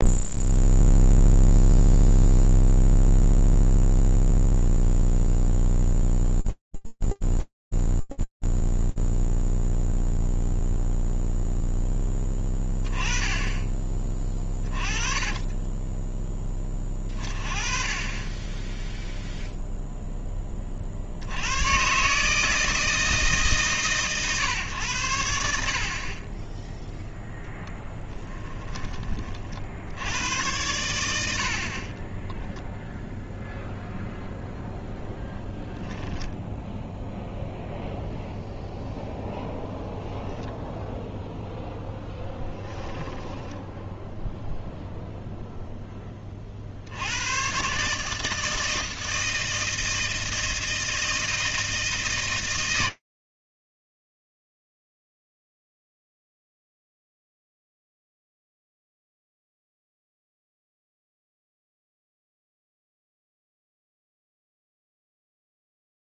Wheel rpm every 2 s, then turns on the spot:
0, 0, 0, 0, 0, 10, 30, 20, 10, 20, 160, 110, 10, 20, 90, 10, 0, 0, 0, 0, 0, 10, 0, 90, 160, 160, 120, 0, 0, 0, 0, 0, 0.
12-14 26-28 30-32 42-44